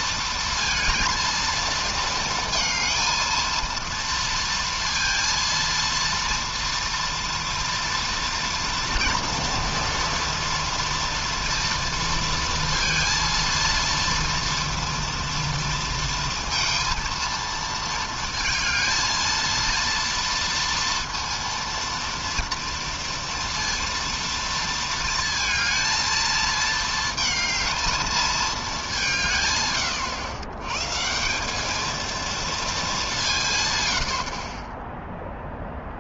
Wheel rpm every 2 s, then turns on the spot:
230, 220, 230, 230, 230, 230, 230, 230, 230, 220, 230, 230, 230, 220, 210, 110, 230, 40.
none